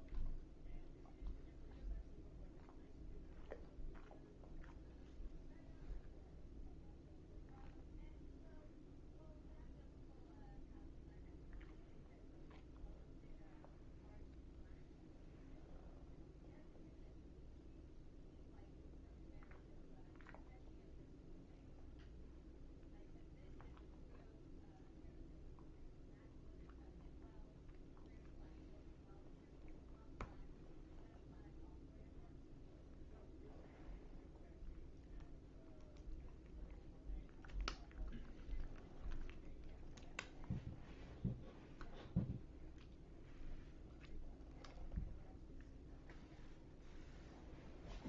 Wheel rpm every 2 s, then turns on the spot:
0, 0, 0, 0, 0, 0, 0, 0, 0, 0, 0, 0, 0, 0, 0, 0, 0, 0, 0, 0, 0, 0, 0, 0.
none